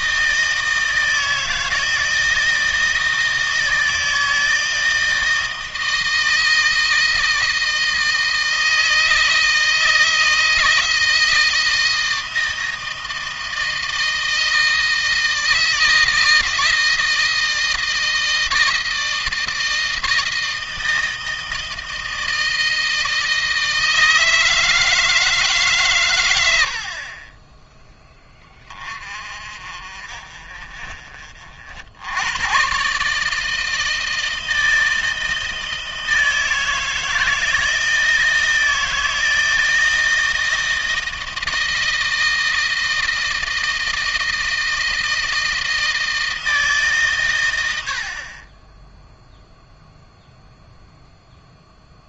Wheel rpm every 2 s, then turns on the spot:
160, 160, 160, 160, 160, 160, 160, 160, 160, 160, 160, 160, 160, 60, 30, 50, 130, 160, 160, 160, 160, 160, 160, 150, 20, 0.
none